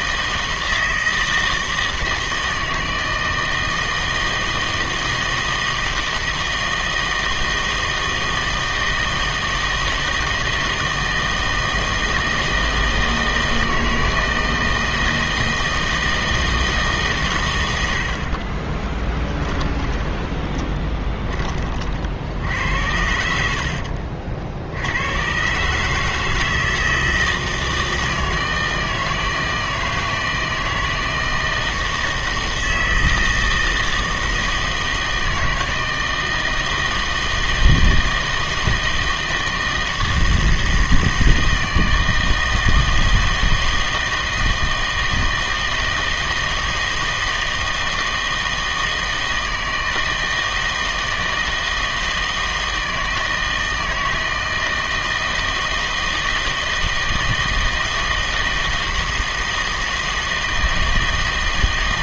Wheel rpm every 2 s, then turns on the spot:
160, 160, 160, 160, 160, 160, 160, 160, 160, 30, 20, 70, 70, 160, 160, 160, 160, 160, 160, 160, 160, 160, 160, 160, 160, 160, 160, 160, 160, 160, 160.
18-22